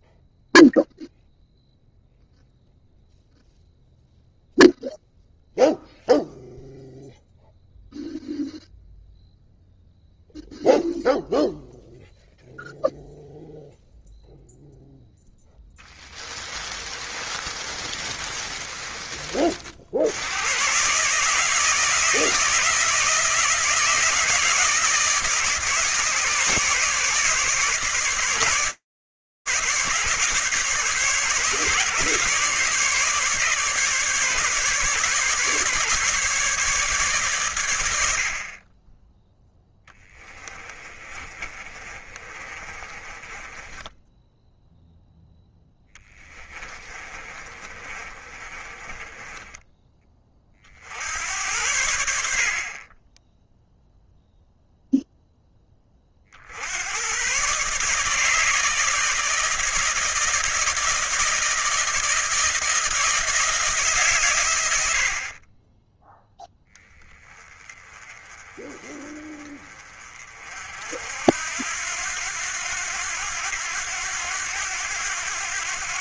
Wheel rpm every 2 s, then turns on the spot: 0, 0, 0, 0, 0, 0, 0, 0, 30, 30, 130, 160, 150, 140, 140, 150, 150, 150, 100, 10, 30, 20, 0, 30, 20, 80, 10, 0, 110, 160, 160, 160, 50, 10, 20, 70, 90, 90.
16-18 40-44 46-50